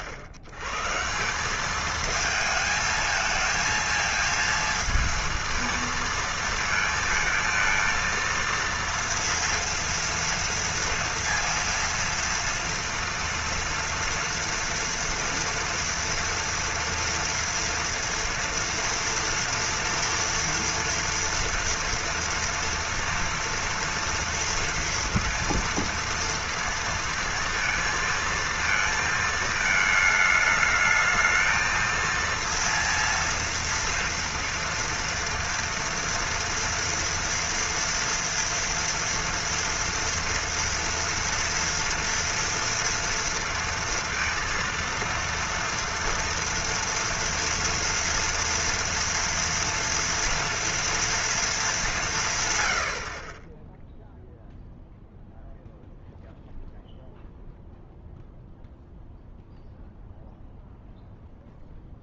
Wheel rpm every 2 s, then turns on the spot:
110, 220, 230, 220, 230, 230, 230, 230, 230, 230, 230, 230, 230, 230, 220, 210, 230, 230, 230, 230, 230, 230, 230, 230, 230, 240, 120, 0, 0, 0, 0.
none